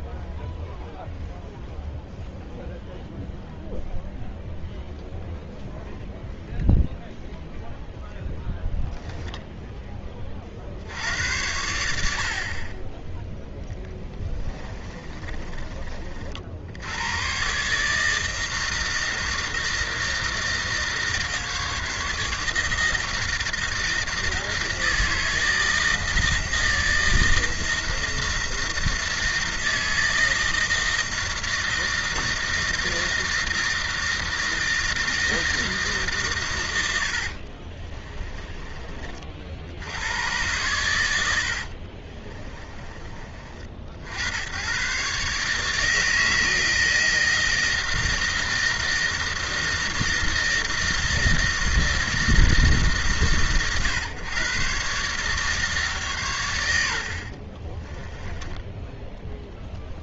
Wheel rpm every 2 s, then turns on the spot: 0, 0, 0, 0, 0, 40, 50, 20, 70, 160, 160, 160, 160, 160, 160, 160, 160, 160, 100, 30, 120, 30, 90, 160, 160, 160, 160, 130, 100, 10.
14-16 42-44 58-60